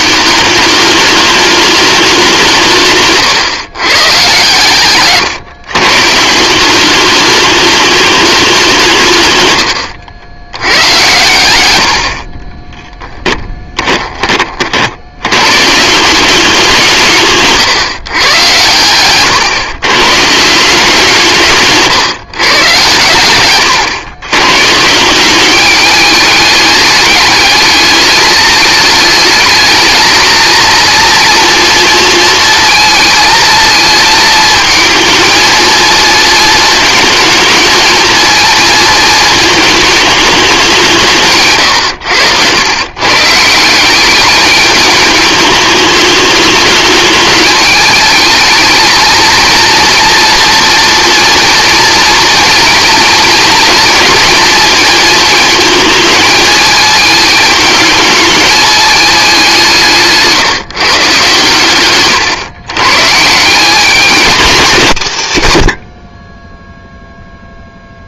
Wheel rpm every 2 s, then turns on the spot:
200, 160, 130, 180, 190, 100, 20, 50, 190, 110, 170, 130, 140, 210, 210, 230, 230, 220, 220, 230, 200, 110, 210, 210, 220, 230, 240, 230, 220, 210, 150, 120, 210, 10.
12-14